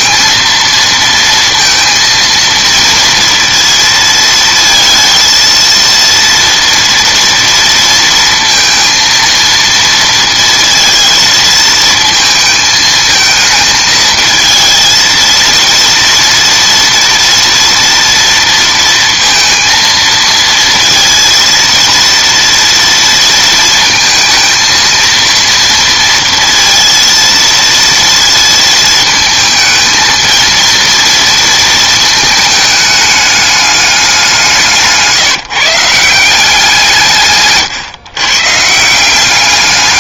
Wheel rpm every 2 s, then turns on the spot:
230, 230, 230, 230, 230, 230, 220, 230, 230, 230, 230, 230, 230, 230, 230, 230, 210, 160, 170, 150.
none